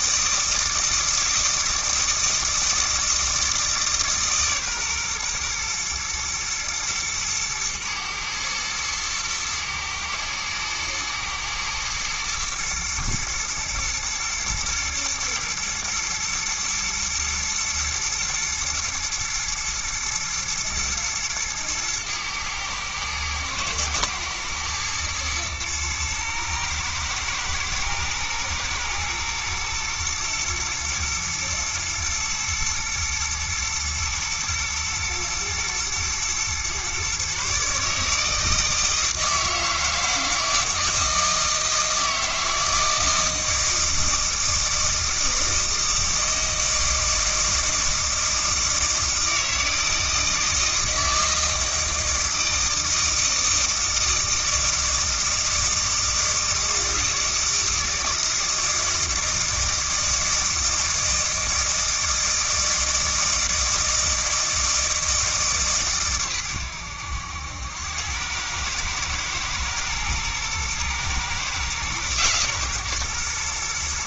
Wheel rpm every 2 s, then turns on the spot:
160, 160, 130, 110, 120, 110, 110, 120, 110, 110, 110, 110, 110, 120, 110, 120, 110, 120, 130, 160, 160, 160, 160, 160, 160, 160, 160, 160, 160, 160, 160, 160, 160, 100, 110, 120, 130.
none